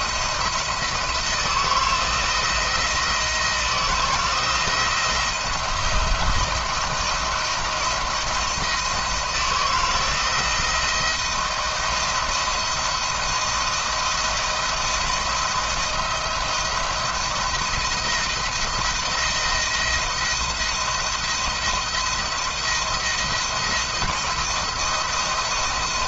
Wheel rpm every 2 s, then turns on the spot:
170, 170, 170, 170, 170, 170, 170, 170, 170, 170, 170, 170, 170.
none